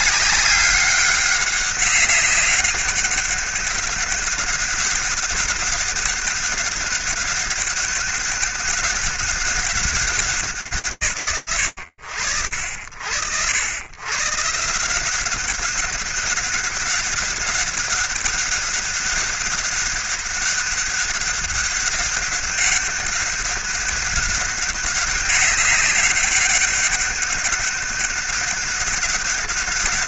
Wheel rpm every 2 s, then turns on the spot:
200, 200, 200, 200, 200, 190, 60, 160, 200, 200, 200, 200, 200, 200, 200.
none